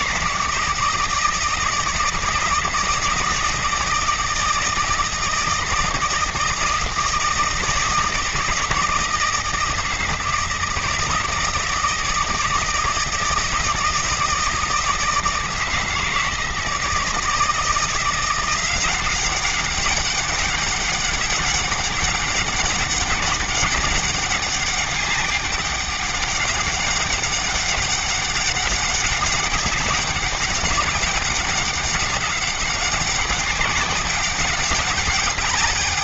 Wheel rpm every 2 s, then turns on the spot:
160, 170, 160, 160, 160, 160, 160, 160, 160, 190, 200, 200, 200, 200, 190, 190, 200, 200.
none